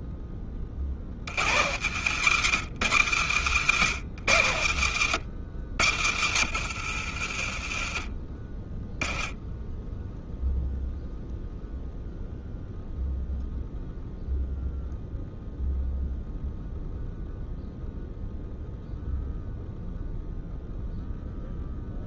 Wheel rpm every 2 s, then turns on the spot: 30, 120, 120, 70, 20, 0, 0, 0, 0, 0, 0.
none